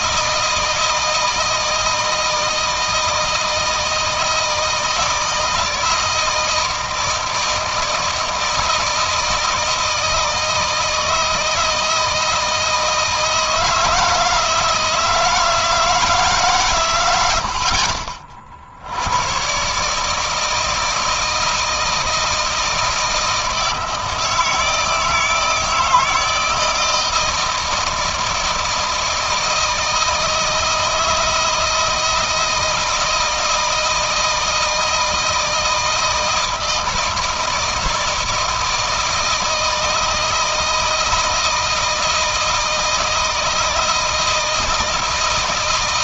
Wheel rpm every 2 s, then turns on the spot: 160, 160, 160, 160, 160, 160, 160, 160, 130, 60, 160, 160, 160, 170, 160, 160, 160, 160, 160, 160, 160, 160, 160.
none